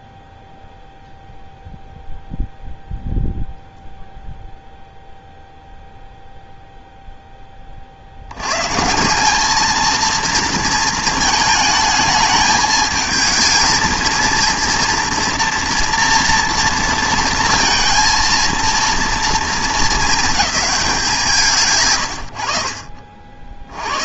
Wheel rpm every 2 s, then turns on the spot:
0, 0, 0, 0, 70, 230, 220, 230, 230, 230, 210, 90.
none